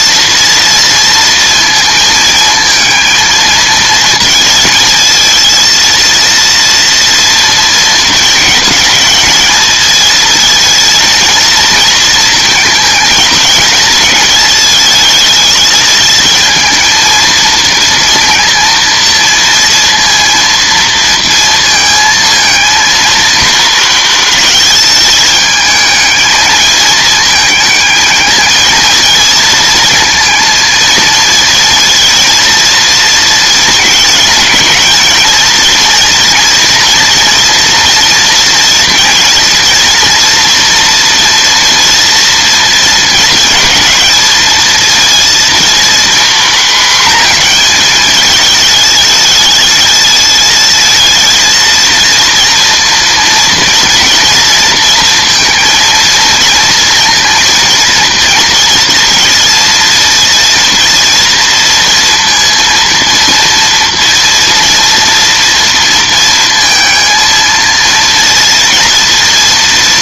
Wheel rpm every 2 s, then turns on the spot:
230, 230, 220, 230, 210, 230, 220, 220, 220, 230, 230, 230, 220, 220, 220, 230, 230, 220, 230, 230, 230, 220, 220, 230, 210, 220, 230, 230, 230, 230, 230, 230, 230, 230, 230.
none